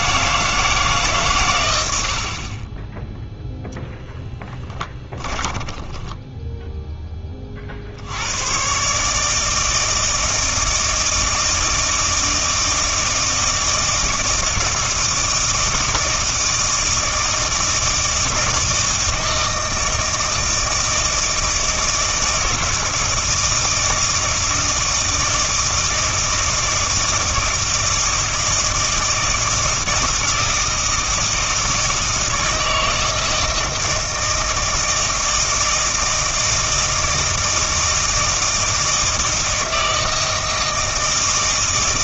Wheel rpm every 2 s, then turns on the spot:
150, 20, 10, 0, 130, 160, 160, 160, 160, 160, 160, 160, 160, 160, 160, 160, 160, 160, 160, 160, 160.
2-6